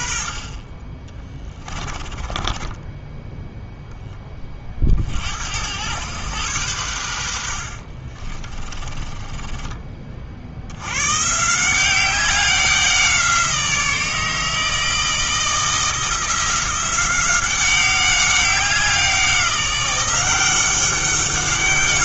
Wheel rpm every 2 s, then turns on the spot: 30, 20, 40, 100, 30, 80, 190, 160, 180, 190, 190.
2-4 8-10